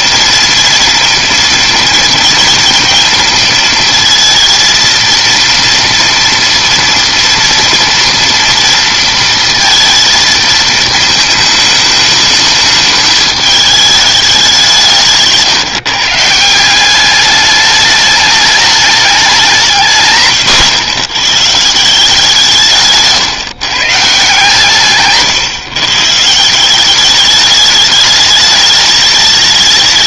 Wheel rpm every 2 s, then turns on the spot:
230, 230, 230, 230, 230, 230, 220, 180, 170, 210, 140, 160, 140, 160, 210.
none